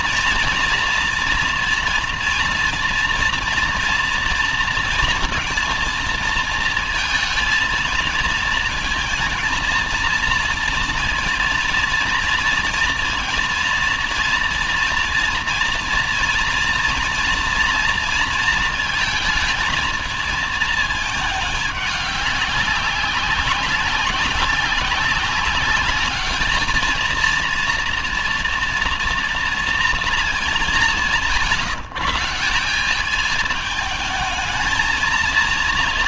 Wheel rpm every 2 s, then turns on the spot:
230, 230, 230, 230, 230, 230, 230, 230, 230, 220, 220, 200, 190, 230, 230, 140, 200, 220.
none